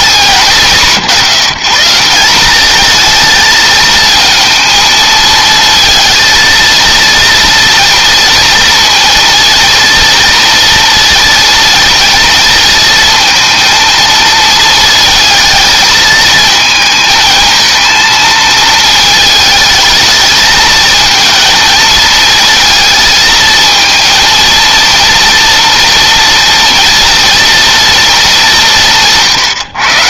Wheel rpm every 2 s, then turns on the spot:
170, 220, 220, 230, 230, 230, 220, 220, 220, 220, 220, 220, 230, 230, 160.
none